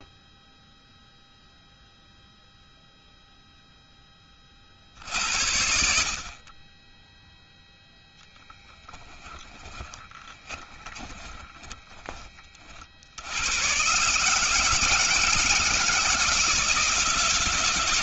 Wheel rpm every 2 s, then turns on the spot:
0, 0, 50, 10, 10, 10, 50, 160, 170.
8-12